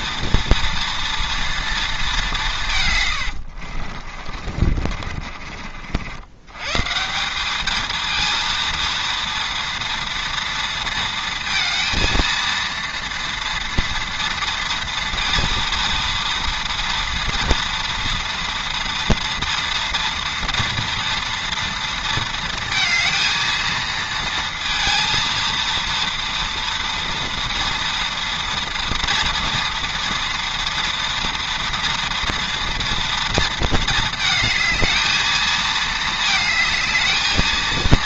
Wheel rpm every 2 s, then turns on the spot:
230, 150, 40, 130, 230, 230, 230, 230, 230, 240, 230, 230, 230, 230, 230, 230, 230, 220, 220.
4-6